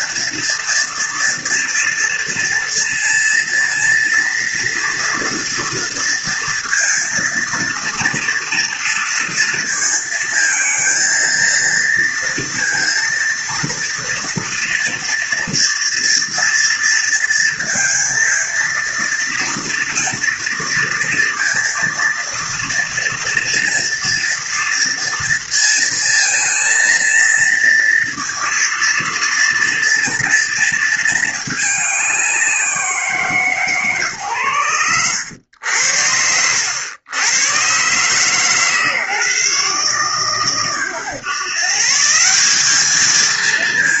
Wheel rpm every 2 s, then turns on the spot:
230, 230, 230, 230, 230, 230, 230, 230, 230, 230, 230, 240, 230, 230, 230, 230, 170, 100, 100, 150, 130, 200.
34-36